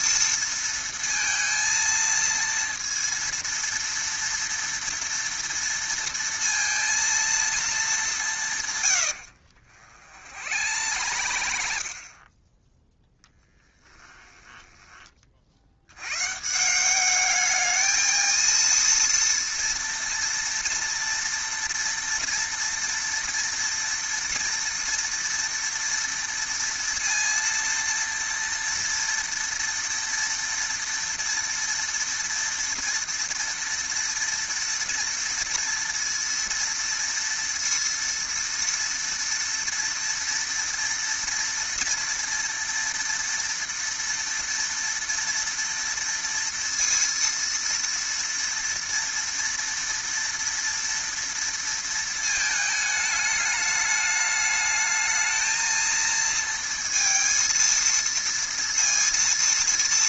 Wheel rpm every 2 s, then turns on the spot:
230, 230, 230, 230, 160, 80, 10, 10, 140, 230, 230, 230, 230, 230, 230, 230, 230, 230, 230, 230, 230, 230, 230, 230, 230, 230, 220, 210, 230, 230.
10-12 14-16